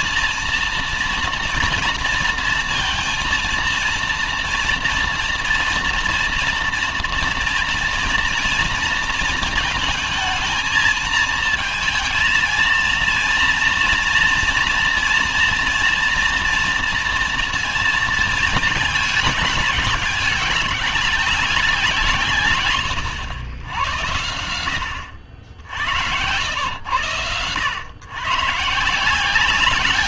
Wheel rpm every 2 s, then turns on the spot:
230, 230, 230, 230, 230, 220, 230, 230, 230, 220, 210, 160, 80, 100, 150.
none